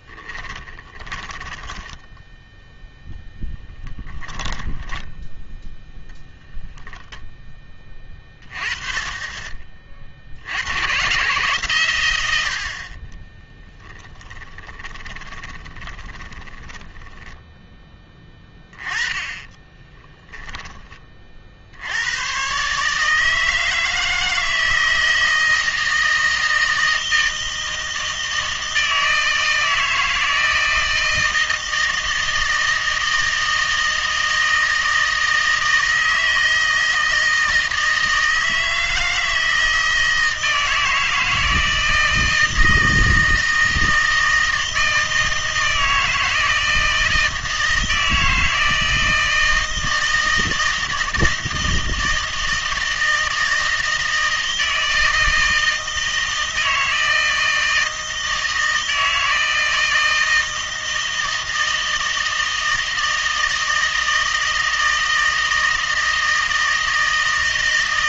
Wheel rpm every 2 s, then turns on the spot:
20, 0, 10, 0, 20, 100, 60, 30, 10, 20, 20, 140, 160, 160, 160, 160, 160, 160, 160, 160, 160, 160, 160, 160, 160, 160, 160, 160, 160, 160, 160, 160, 160, 160.
0-2 14-20